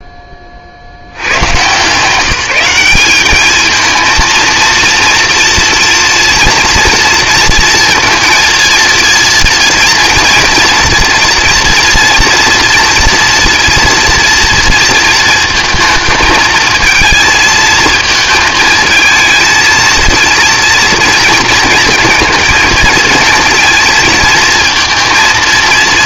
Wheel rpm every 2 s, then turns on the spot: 40, 180, 230, 230, 230, 230, 240, 230, 230, 220, 230, 230, 230.
none